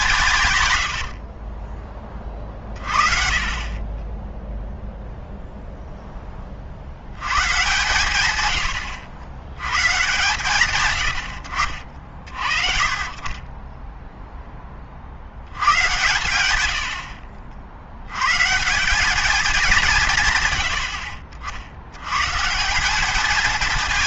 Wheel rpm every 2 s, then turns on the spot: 120, 50, 0, 40, 120, 120, 40, 20, 80, 140, 110, 160.
0-2